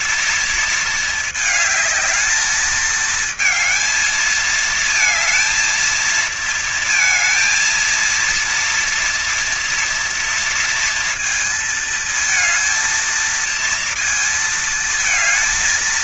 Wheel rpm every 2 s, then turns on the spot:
220, 220, 220, 230, 230, 230, 220, 230.
none